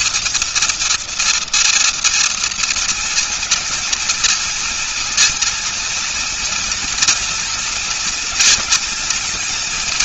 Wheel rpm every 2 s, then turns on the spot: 230, 230, 230, 230, 240.
none